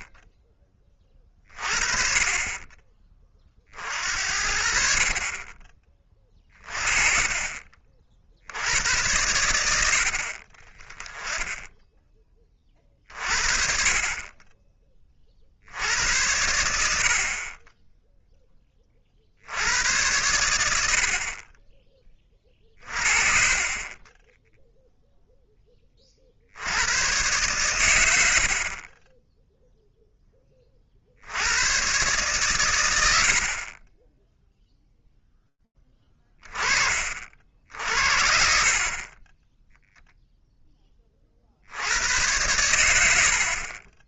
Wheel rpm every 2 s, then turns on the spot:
20, 30, 60, 30, 70, 30, 40, 20, 80, 20, 80, 40, 0, 80, 40, 30, 120, 0, 30, 50, 10, 100.
none